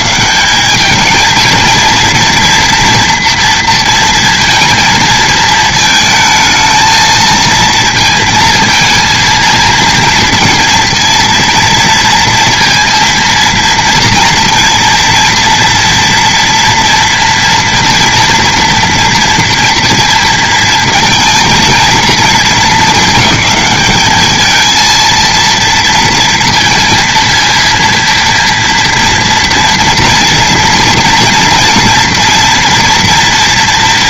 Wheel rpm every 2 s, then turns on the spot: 80, 230, 230, 220, 230, 230, 230, 230, 240, 230, 230, 230, 210, 230, 230, 240, 240.
none